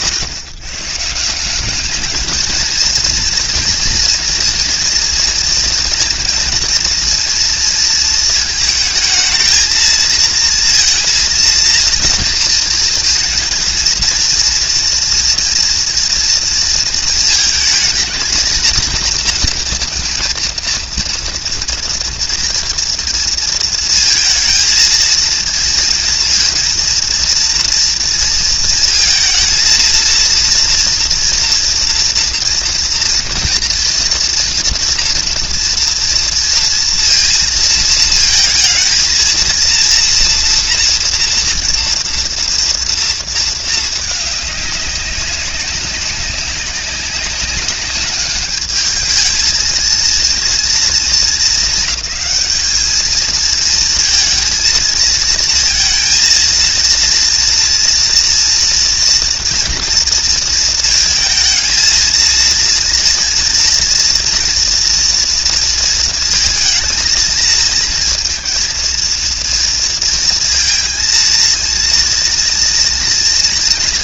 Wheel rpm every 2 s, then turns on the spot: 140, 220, 230, 240, 220, 230, 230, 230, 230, 220, 230, 230, 230, 230, 230, 230, 230, 240, 230, 220, 230, 230, 200, 190, 210, 230, 220, 220, 230, 230, 230, 230, 230, 230, 230, 230, 230.
none